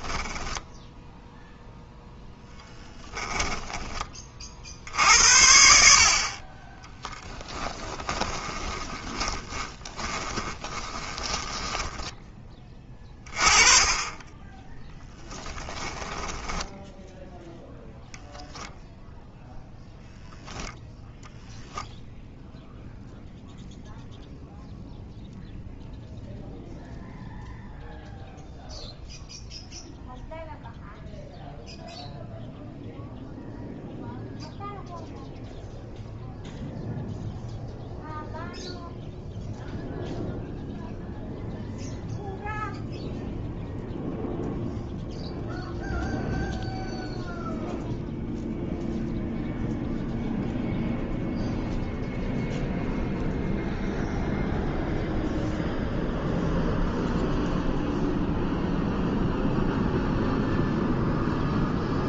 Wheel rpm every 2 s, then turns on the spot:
10, 10, 60, 20, 10, 20, 30, 10, 0, 0, 0, 0, 0, 0, 0, 0, 0, 0, 0, 0, 0, 0, 0, 0, 0, 0, 0, 0, 0, 0, 0.
2-4 8-12